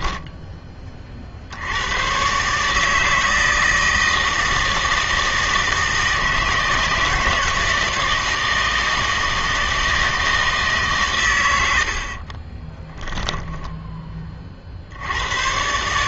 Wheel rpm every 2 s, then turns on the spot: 10, 140, 160, 160, 160, 150, 20, 50.
12-14